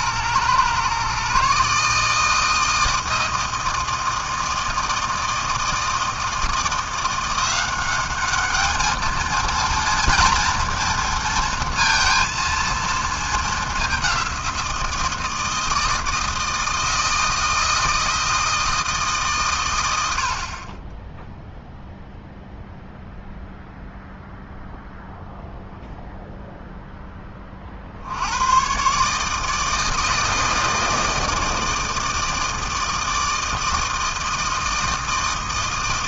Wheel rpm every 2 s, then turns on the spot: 120, 160, 160, 160, 210, 230, 230, 180, 160, 160, 50, 0, 0, 0, 100, 160, 160, 160.
none